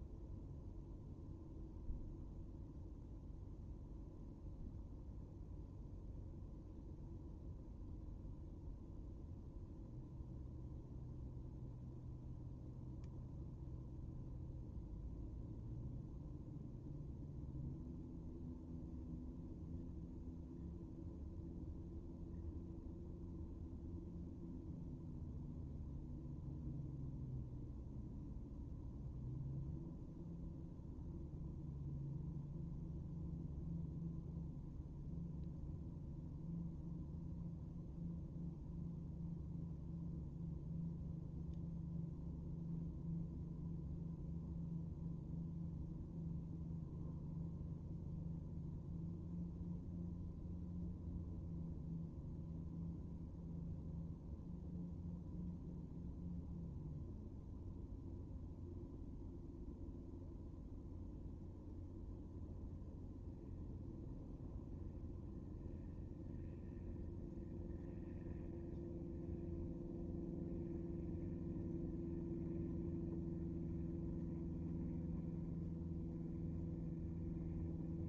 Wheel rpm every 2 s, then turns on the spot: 0, 0, 0, 0, 0, 0, 0, 0, 0, 0, 0, 0, 0, 0, 0, 0, 0, 0, 0, 0, 0, 0, 0, 0, 0, 0, 0, 0, 0, 0, 0, 0, 0, 0, 0, 0, 0, 0, 0.
none